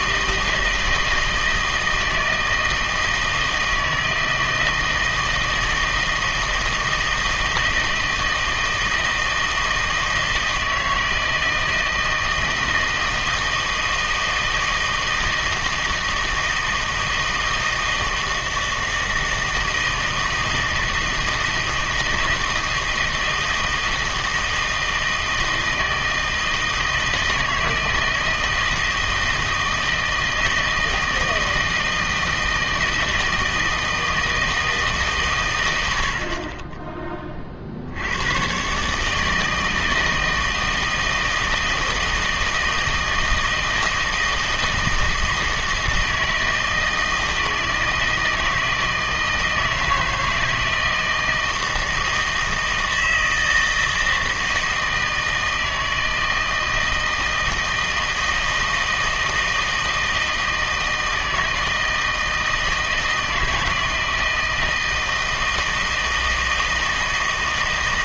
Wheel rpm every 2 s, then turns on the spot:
160, 160, 160, 160, 160, 160, 160, 160, 160, 160, 160, 160, 160, 160, 160, 160, 160, 160, 30, 130, 160, 160, 160, 160, 160, 160, 160, 160, 160, 160, 160, 160, 160, 160.
none